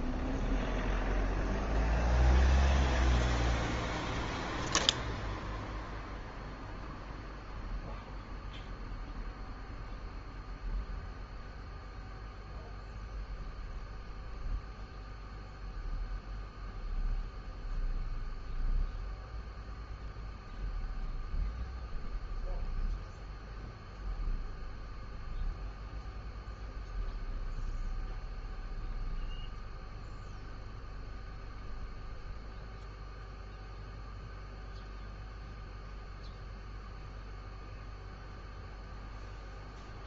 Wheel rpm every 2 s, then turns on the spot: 0, 0, 0, 0, 0, 0, 0, 0, 0, 0, 0, 0, 0, 0, 0, 0, 0, 0, 0, 0.
none